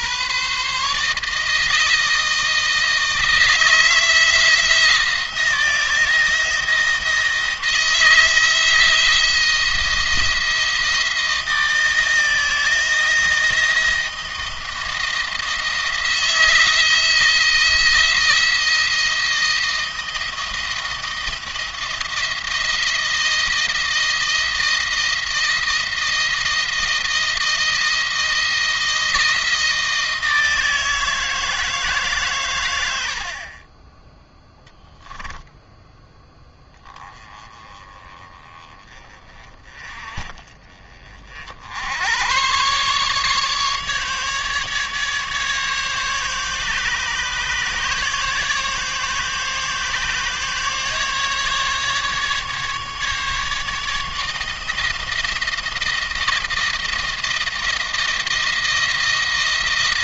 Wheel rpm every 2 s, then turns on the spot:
140, 160, 170, 170, 170, 170, 160, 170, 160, 170, 170, 170, 160, 160, 160, 160, 120, 10, 20, 20, 40, 120, 150, 140, 150, 140, 150, 160, 160, 160.
34-36